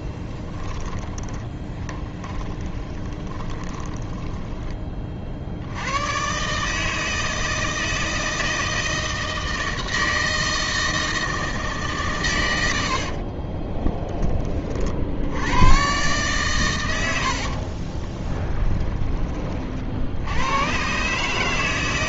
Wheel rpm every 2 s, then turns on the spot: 10, 20, 20, 150, 160, 160, 90, 60, 100, 20, 130.
0-4 12-14